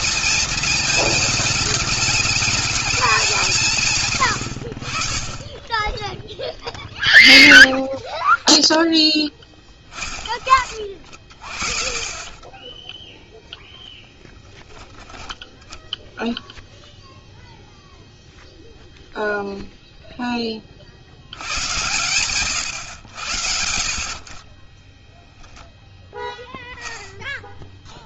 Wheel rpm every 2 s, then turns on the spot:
220, 210, 60, 10, 10, 30, 10, 10, 0, 0, 50, 100, 20, 10.
12-14 24-26